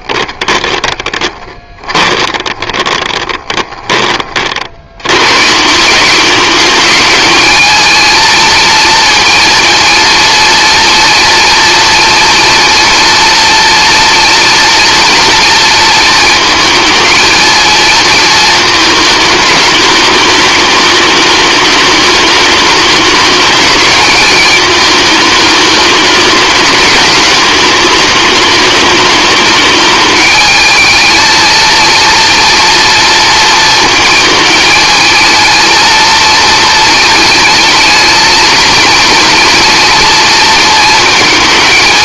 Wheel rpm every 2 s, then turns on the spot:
30, 20, 90, 210, 230, 230, 230, 230, 220, 220, 220, 210, 210, 210, 210, 220, 230, 220, 220, 230, 230.
0-4